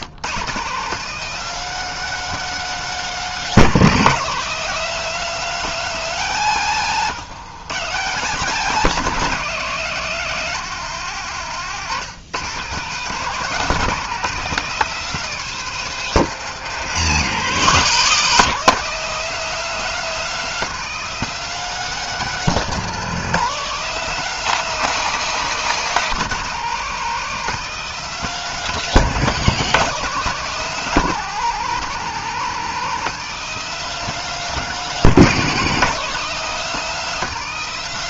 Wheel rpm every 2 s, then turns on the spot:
170, 210, 200, 180, 180, 180, 150, 200, 170, 180, 210, 200, 200, 190, 190, 190, 180, 200, 190.
none